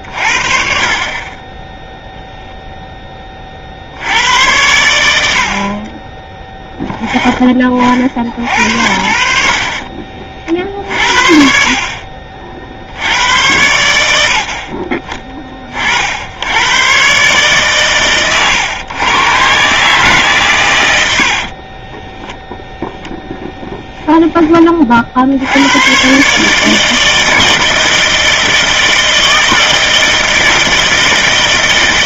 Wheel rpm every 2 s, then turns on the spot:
40, 10, 100, 20, 60, 50, 70, 50, 110, 110, 110, 10, 40, 160, 160, 160.
none